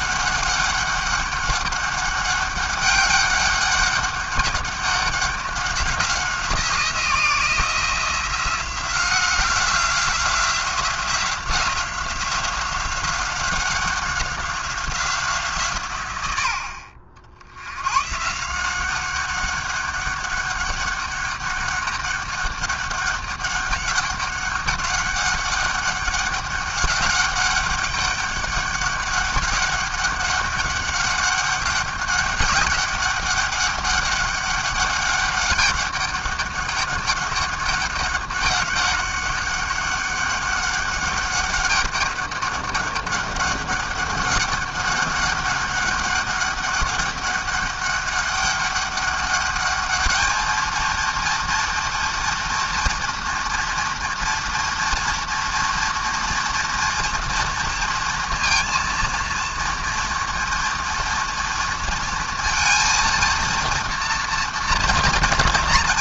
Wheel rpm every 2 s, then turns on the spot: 200, 200, 200, 170, 180, 180, 180, 180, 70, 180, 200, 200, 200, 200, 200, 200, 200, 200, 200, 190, 200, 200, 200, 200, 200, 230, 230, 230, 230, 230, 240, 230, 230.
none